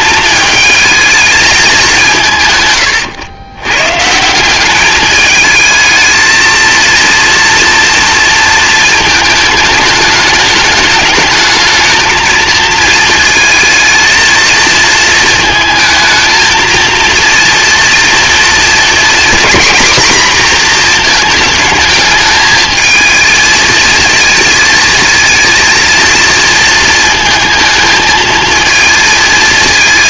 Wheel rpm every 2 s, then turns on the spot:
220, 120, 200, 230, 220, 210, 220, 220, 230, 240, 240, 220, 230, 220, 230.
none